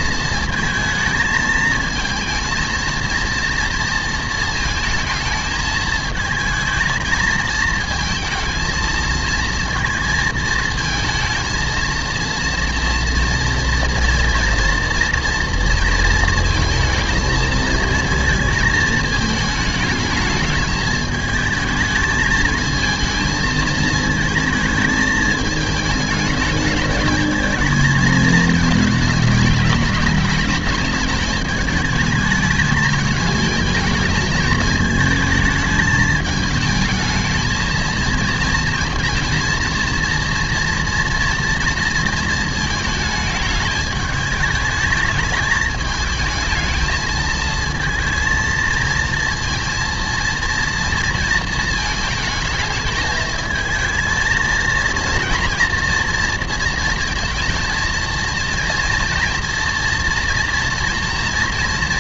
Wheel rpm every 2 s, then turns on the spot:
220, 230, 230, 230, 230, 230, 230, 230, 220, 230, 220, 220, 220, 210, 220, 210, 220, 220, 220, 220, 230, 220, 220, 220, 230, 230, 220, 230, 230, 230, 230.
none